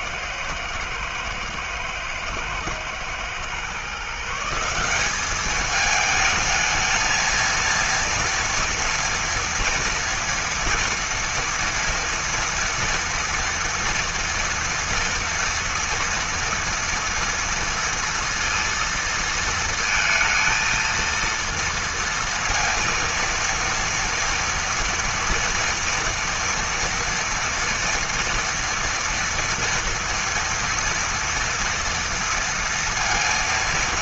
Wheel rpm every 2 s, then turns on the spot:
110, 110, 180, 220, 240, 240, 230, 230, 230, 230, 230, 230, 230, 230, 230, 230, 230.
none